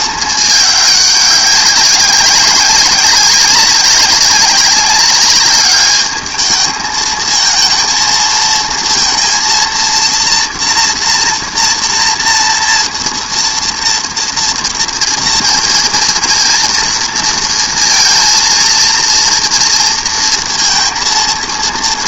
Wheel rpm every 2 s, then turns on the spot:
210, 200, 200, 220, 230, 230, 230, 230, 230, 230, 230.
none